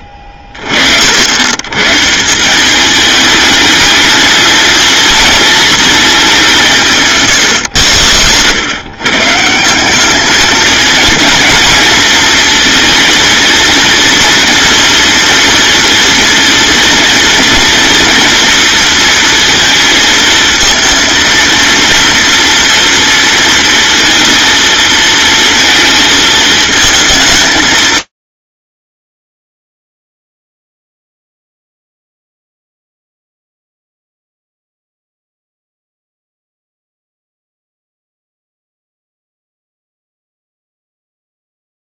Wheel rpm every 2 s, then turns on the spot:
60, 210, 230, 170, 130, 230, 230, 240, 240, 230, 230, 230, 230, 220, 40, 0, 0, 0, 0, 0, 0.
6-8